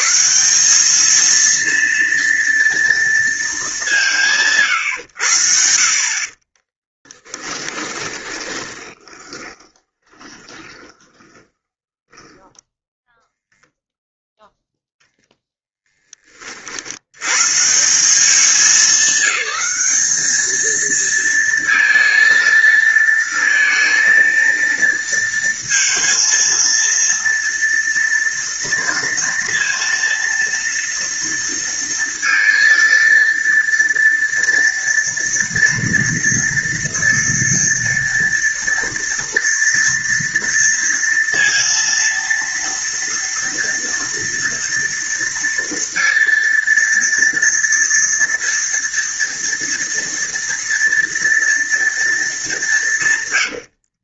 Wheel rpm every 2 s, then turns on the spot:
200, 230, 140, 20, 20, 30, 10, 0, 70, 200, 220, 230, 230, 230, 230, 230, 230, 230, 230, 230, 230, 230, 230, 230, 230, 230, 180.
6-14